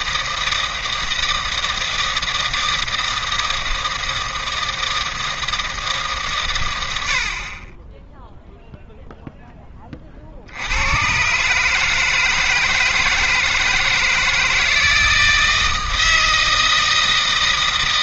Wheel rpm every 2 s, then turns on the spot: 160, 160, 160, 120, 0, 80, 160, 160, 160.
none